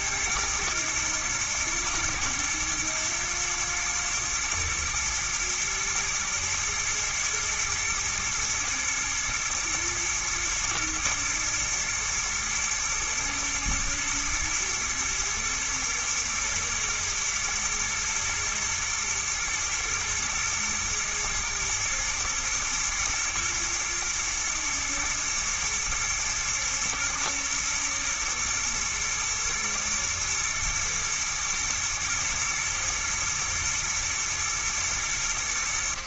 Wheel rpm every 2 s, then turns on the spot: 110, 110, 110, 120, 120, 120, 120, 120, 110, 110, 110, 120, 120, 120, 110, 120, 120, 110.
none